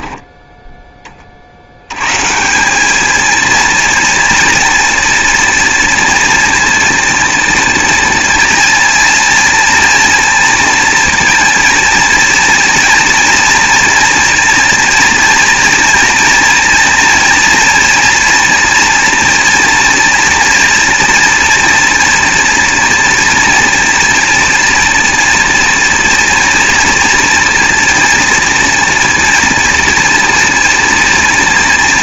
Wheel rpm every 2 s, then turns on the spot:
10, 190, 230, 240, 230, 230, 230, 240, 230, 240, 230, 230, 240, 230, 230, 240.
none